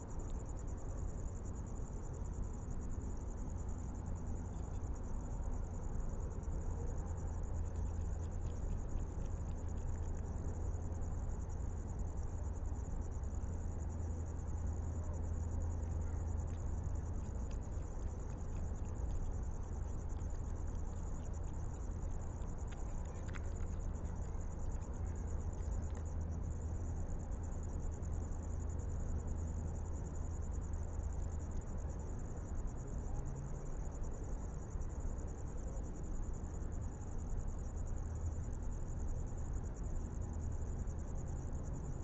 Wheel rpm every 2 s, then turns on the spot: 0, 0, 0, 0, 0, 0, 0, 0, 0, 0, 0, 0, 0, 0, 0, 0, 0, 0, 0, 0, 0.
none